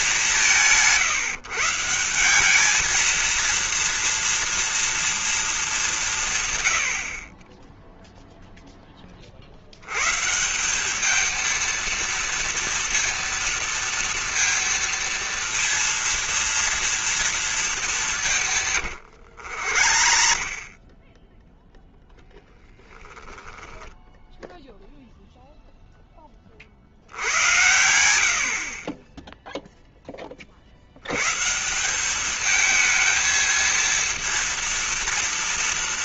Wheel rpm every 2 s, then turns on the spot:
200, 180, 230, 180, 0, 130, 230, 230, 230, 170, 50, 0, 0, 30, 70, 40, 210, 230.
18-22